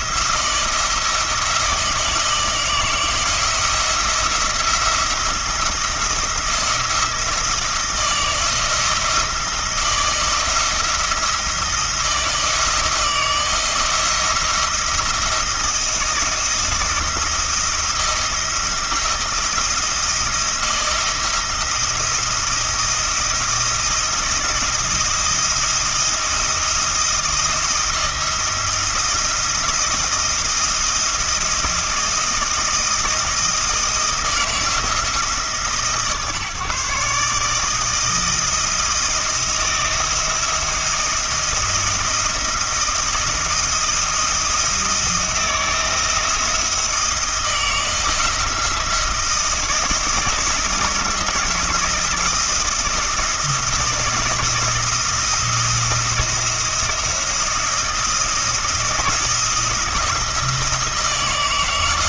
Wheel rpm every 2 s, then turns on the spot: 170, 160, 170, 160, 160, 170, 170, 170, 170, 170, 170, 170, 170, 170, 170, 170, 170, 160, 140, 160, 170, 170, 170, 160, 170, 160, 170, 170, 170, 170, 160.
none